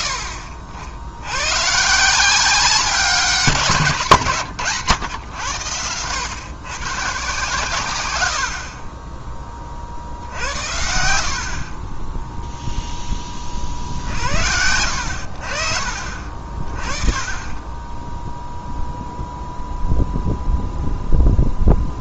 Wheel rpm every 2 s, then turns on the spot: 80, 190, 130, 130, 30, 70, 10, 80, 30, 0, 0.
none